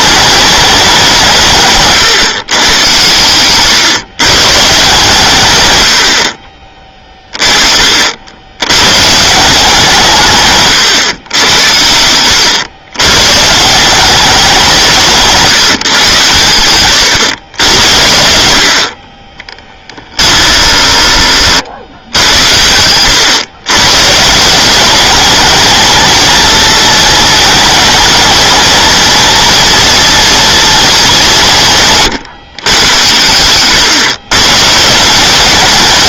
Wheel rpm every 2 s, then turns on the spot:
190, 120, 150, 30, 100, 130, 110, 180, 110, 60, 20, 100, 190, 230, 220, 220, 120, 150.
10-12 20-22